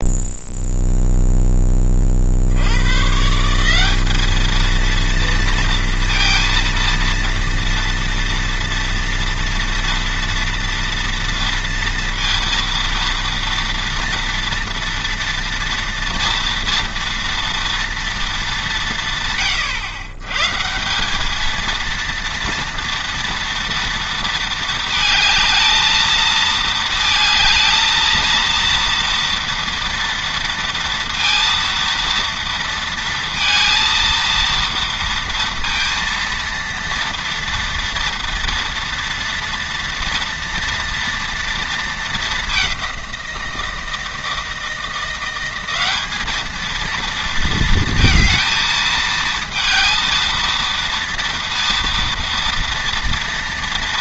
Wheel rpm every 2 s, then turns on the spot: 0, 90, 230, 230, 230, 230, 230, 230, 230, 180, 170, 230, 220, 230, 230, 230, 230, 230, 230, 230, 230, 190, 170, 230, 220, 230, 230.
none